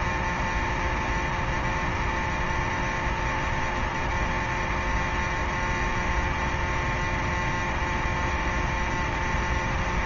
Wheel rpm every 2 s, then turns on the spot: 0, 0, 0, 0, 0.
none